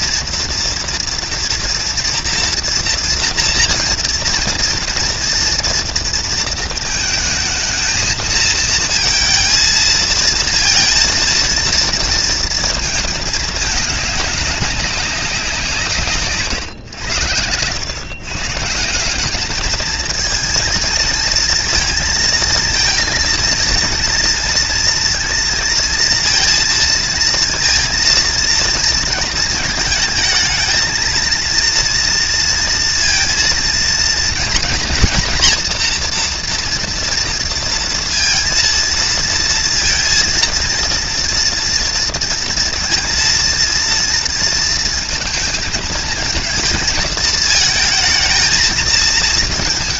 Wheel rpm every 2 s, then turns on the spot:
230, 240, 230, 230, 220, 230, 230, 200, 130, 160, 230, 230, 230, 230, 230, 230, 230, 240, 230, 230, 230, 230, 230, 220, 220.
none